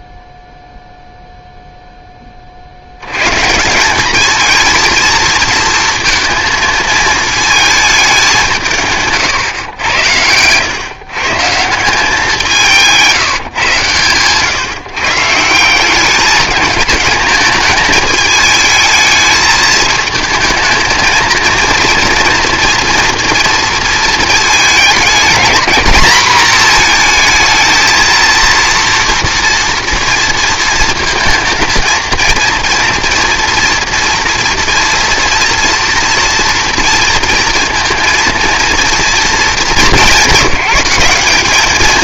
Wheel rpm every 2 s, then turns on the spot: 0, 50, 230, 220, 160, 130, 160, 140, 220, 220, 220, 240, 220, 220, 230, 230, 230, 230, 230, 220, 190.
12-14